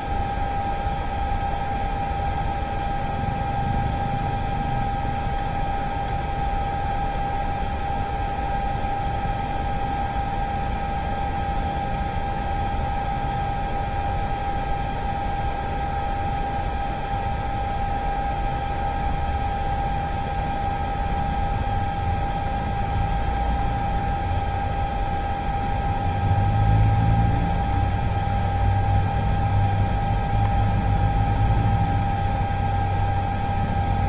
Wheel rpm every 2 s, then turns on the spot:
0, 0, 0, 0, 0, 0, 0, 0, 0, 0, 0, 0, 0, 0, 0, 0, 0.
none